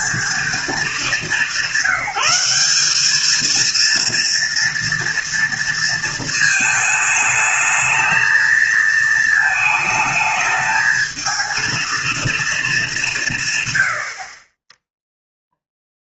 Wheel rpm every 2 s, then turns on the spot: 220, 200, 230, 220, 230, 220, 220, 20.
none